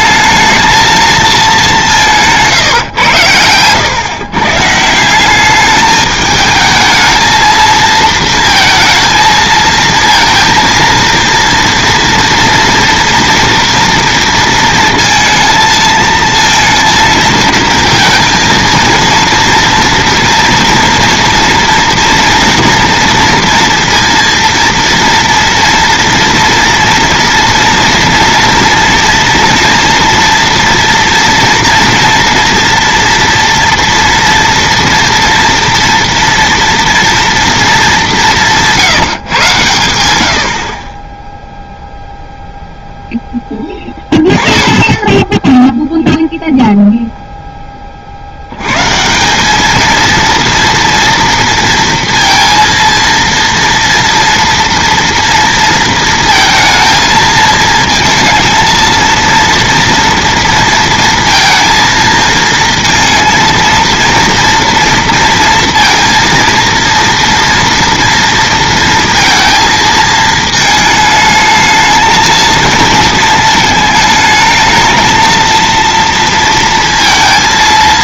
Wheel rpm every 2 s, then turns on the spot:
220, 160, 140, 220, 230, 230, 230, 230, 230, 220, 230, 240, 230, 230, 230, 230, 240, 230, 230, 170, 60, 0, 10, 0, 100, 230, 230, 230, 230, 230, 230, 230, 230, 230, 230, 220, 230, 220, 230.
2-4